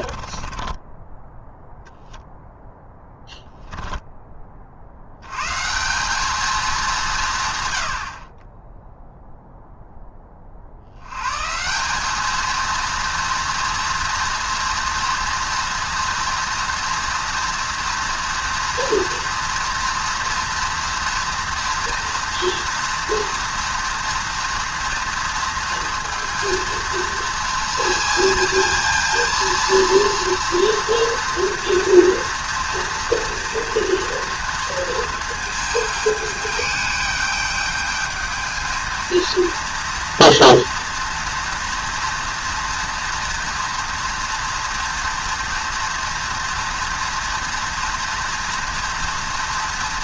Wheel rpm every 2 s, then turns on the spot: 20, 10, 60, 190, 0, 70, 230, 230, 230, 230, 230, 230, 230, 230, 220, 230, 230, 230, 210, 220, 230, 230, 230, 230, 230.
0-4